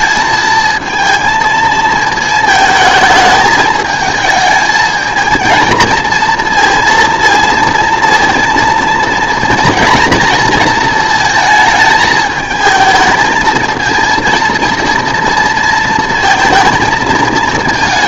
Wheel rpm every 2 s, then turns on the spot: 220, 220, 220, 230, 230, 230, 220, 230, 230.
none